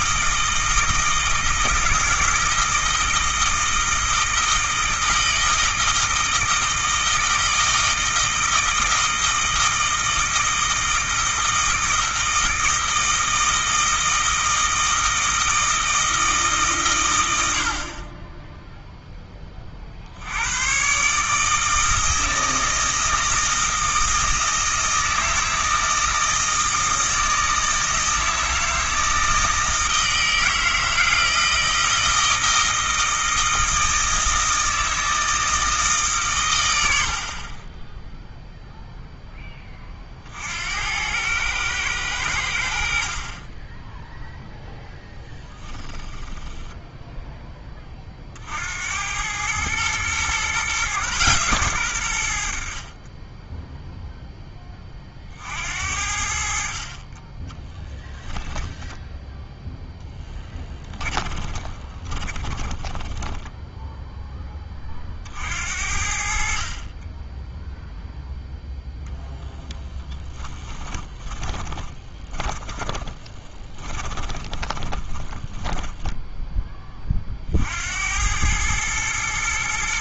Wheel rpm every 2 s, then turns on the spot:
160, 160, 160, 160, 160, 160, 160, 160, 120, 0, 120, 160, 160, 160, 160, 160, 160, 160, 90, 0, 80, 70, 0, 10, 80, 130, 40, 20, 40, 10, 10, 20, 30, 40, 0, 20, 20, 20, 20, 110.
46-48 58-64 70-76